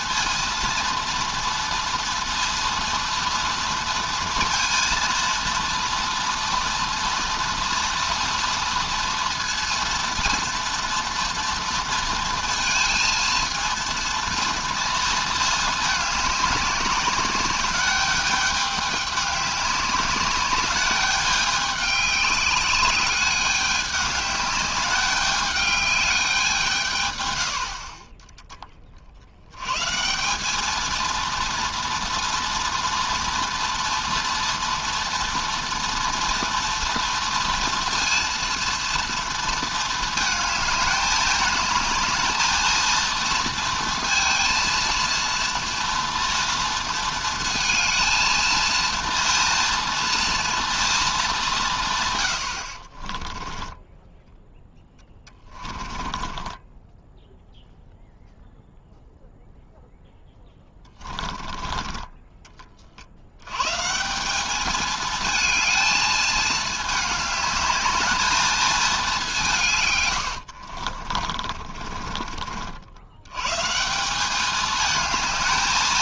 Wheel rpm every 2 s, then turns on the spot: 230, 230, 230, 240, 230, 240, 230, 230, 200, 200, 200, 200, 210, 170, 30, 210, 230, 230, 230, 230, 210, 230, 230, 230, 230, 230, 70, 10, 10, 0, 10, 40, 210, 220, 220, 60, 50, 210.
52-58 60-62 70-72